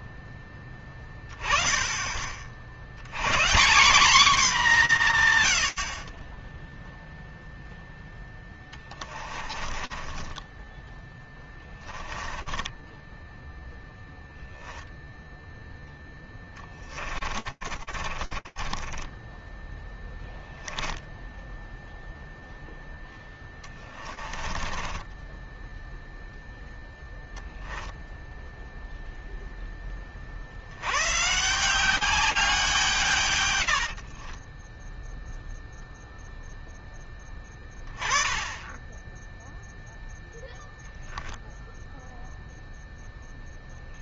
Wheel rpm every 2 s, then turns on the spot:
10, 40, 220, 20, 0, 20, 10, 0, 30, 20, 10, 10, 10, 0, 0, 160, 110, 0, 10, 0, 0, 0.
10-14 16-26 32-34